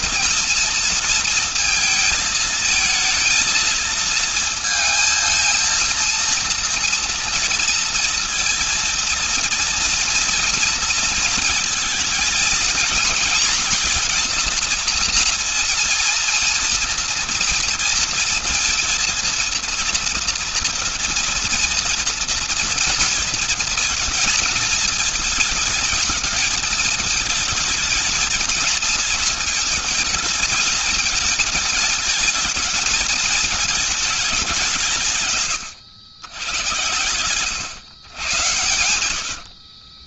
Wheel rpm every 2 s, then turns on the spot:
230, 220, 230, 230, 230, 230, 230, 230, 230, 230, 230, 230, 230, 220, 220, 220, 220, 190, 110, 110.
none